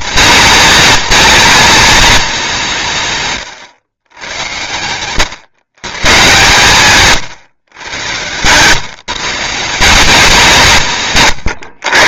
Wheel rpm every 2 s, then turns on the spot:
220, 210, 110, 130, 130, 170.
none